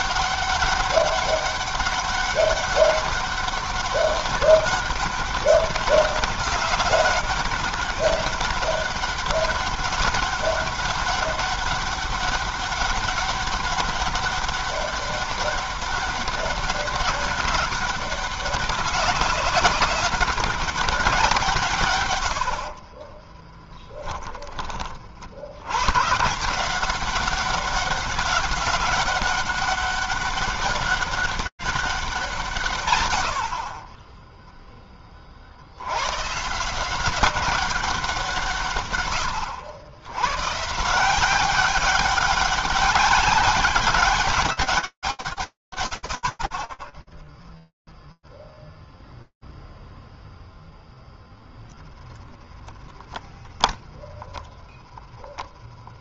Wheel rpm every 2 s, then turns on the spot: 190, 200, 200, 200, 190, 200, 200, 200, 200, 200, 200, 90, 20, 170, 190, 200, 150, 10, 150, 160, 130, 200, 130, 0, 0, 0, 0, 10.
22-24 54-56